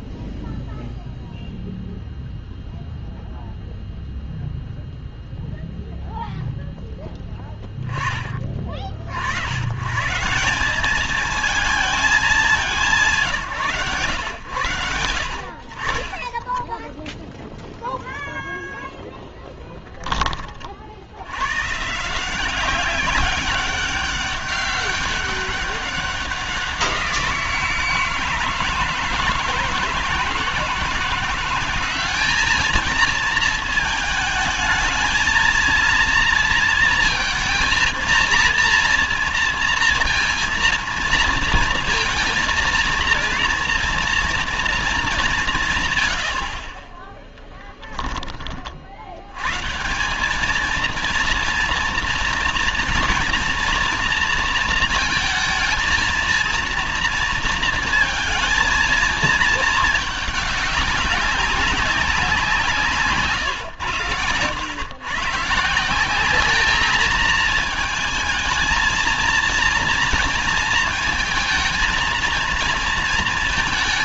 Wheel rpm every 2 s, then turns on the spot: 0, 0, 0, 0, 30, 180, 200, 100, 10, 0, 40, 180, 200, 190, 160, 160, 210, 220, 230, 230, 230, 230, 230, 60, 30, 200, 230, 230, 230, 230, 210, 170, 120, 210, 220, 230, 230.
none